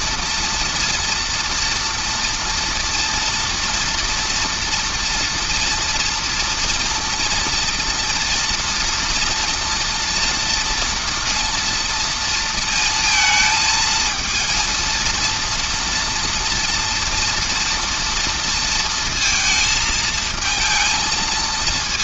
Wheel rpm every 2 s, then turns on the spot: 230, 230, 230, 230, 230, 230, 230, 230, 240, 230, 230.
none